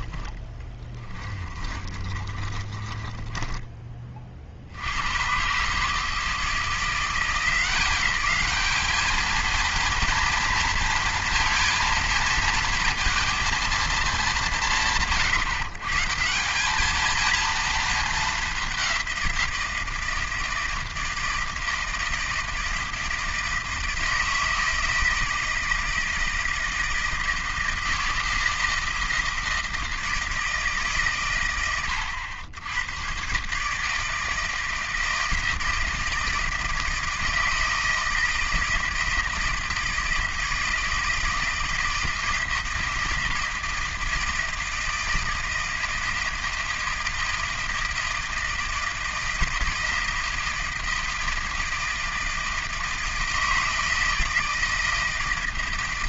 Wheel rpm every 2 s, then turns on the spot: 20, 20, 80, 170, 220, 230, 230, 170, 200, 200, 160, 160, 160, 160, 160, 150, 110, 160, 160, 160, 160, 160, 160, 160, 160, 160, 160, 160.
0-4